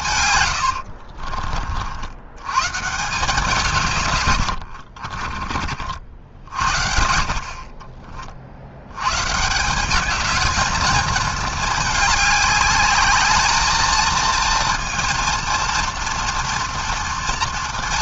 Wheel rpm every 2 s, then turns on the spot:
40, 180, 40, 60, 140, 220, 220, 230, 230.
0-2 4-6